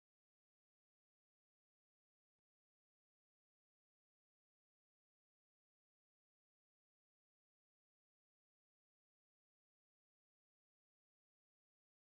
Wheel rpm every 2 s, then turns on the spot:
0, 0, 0, 0, 0, 0.
none